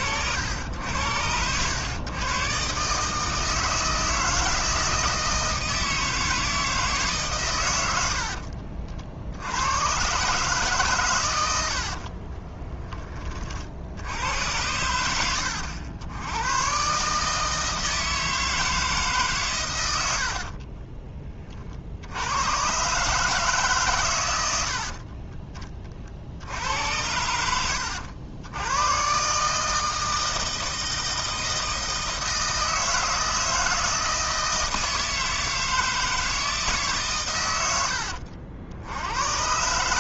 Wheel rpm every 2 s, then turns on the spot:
90, 140, 160, 160, 50, 130, 10, 90, 120, 160, 30, 130, 70, 80, 110, 160, 160, 160, 150, 70.
20-22